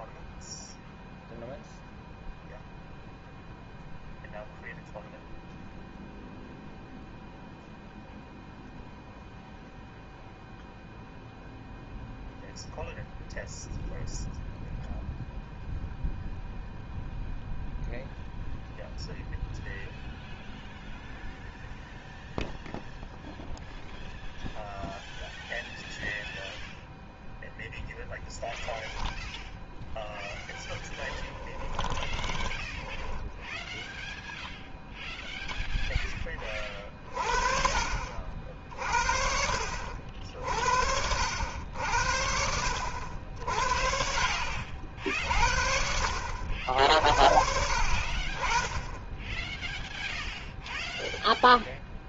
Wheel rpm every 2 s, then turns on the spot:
0, 0, 0, 0, 0, 0, 0, 0, 0, 0, 0, 0, 0, 0, 0, 10, 30, 10, 30, 60, 60, 70, 60, 60, 20, 0.
30-32